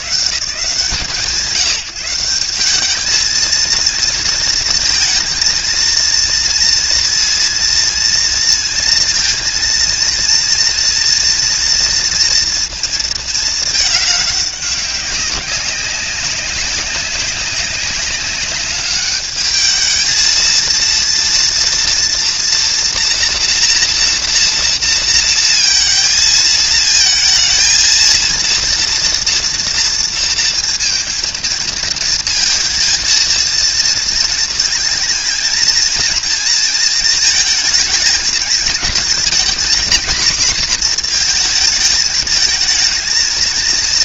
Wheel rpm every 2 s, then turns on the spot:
110, 190, 230, 230, 230, 230, 230, 200, 190, 200, 230, 230, 230, 220, 230, 230, 230, 230, 220, 230, 250, 220.
none